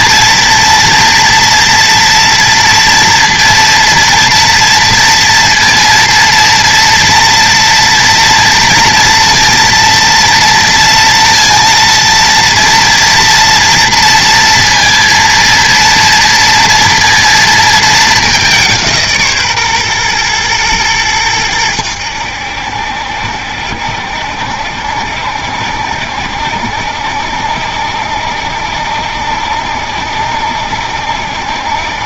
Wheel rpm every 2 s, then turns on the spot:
230, 230, 230, 230, 230, 230, 230, 230, 230, 180, 120, 70, 70, 70, 60, 70.
none